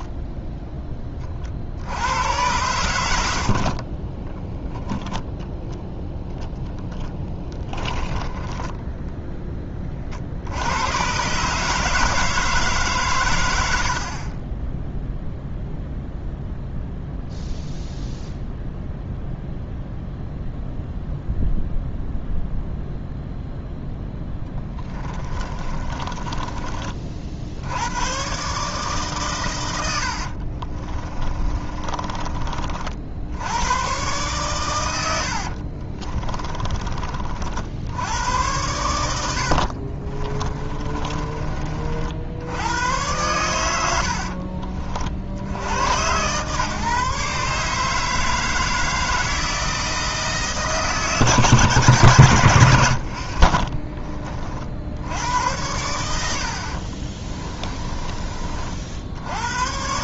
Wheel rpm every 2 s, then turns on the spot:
20, 80, 0, 0, 10, 100, 140, 10, 0, 0, 0, 0, 20, 30, 140, 30, 50, 110, 30, 100, 20, 100, 40, 140, 160, 150, 80, 70, 50, 60.
14-16 24-26 30-32 40-42 52-54 56-58